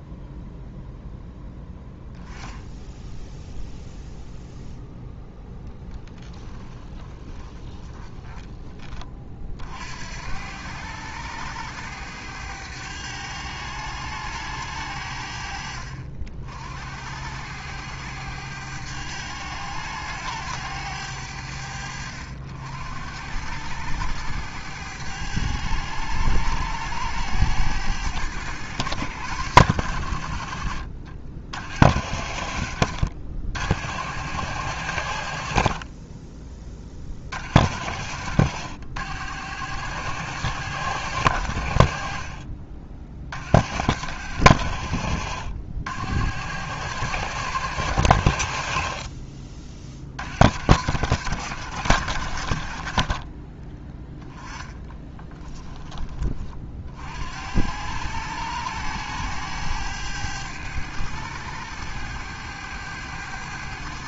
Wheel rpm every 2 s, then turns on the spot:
0, 10, 0, 20, 30, 100, 100, 70, 80, 100, 90, 80, 100, 100, 100, 60, 70, 80, 40, 80, 90, 50, 80, 100, 40, 90, 30, 20, 50, 100, 100, 100.
6-8 54-56